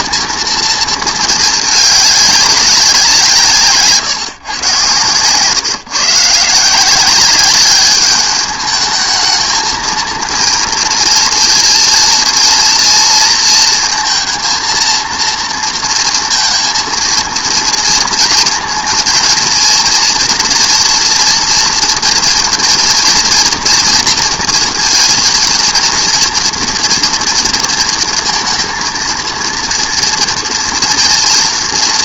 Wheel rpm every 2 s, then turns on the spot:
220, 200, 120, 170, 210, 230, 230, 230, 230, 230, 230, 230, 230, 230, 230, 230.
none